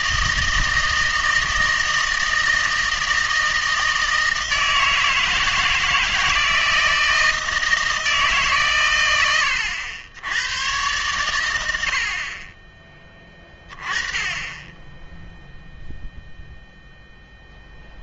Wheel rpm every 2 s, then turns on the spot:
160, 160, 160, 160, 140, 110, 20, 10, 0.
none